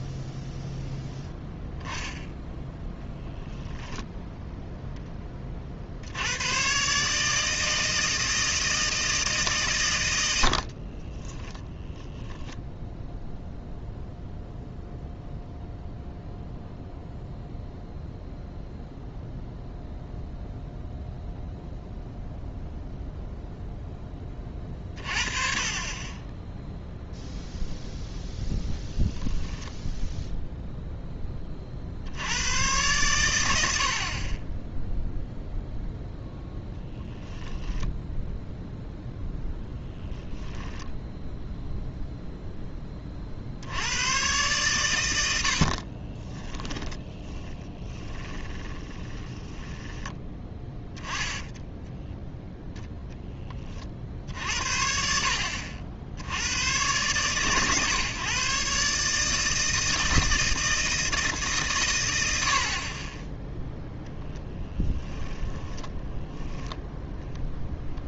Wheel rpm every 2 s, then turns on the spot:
0, 0, 30, 150, 150, 20, 0, 0, 0, 0, 0, 0, 30, 0, 10, 10, 110, 0, 0, 0, 10, 10, 130, 30, 30, 10, 0, 60, 100, 140, 160, 80, 10, 0.
10-12 40-42 46-50 64-66